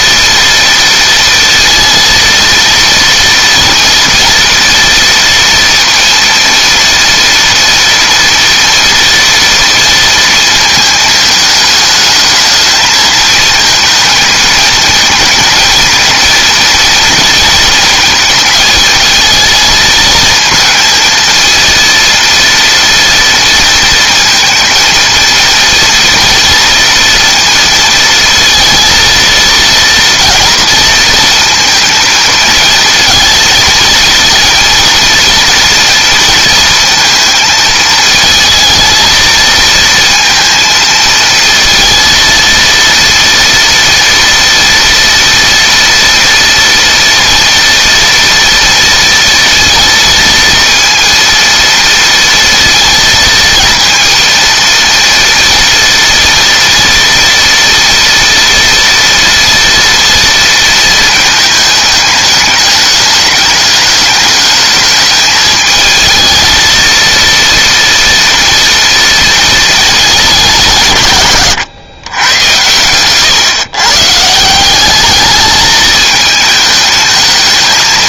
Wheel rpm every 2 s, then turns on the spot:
230, 230, 230, 230, 240, 220, 220, 220, 230, 220, 220, 230, 230, 230, 230, 220, 230, 230, 230, 230, 230, 230, 230, 230, 230, 230, 230, 230, 230, 230, 230, 210, 210, 230, 230, 170, 120, 200, 220.
none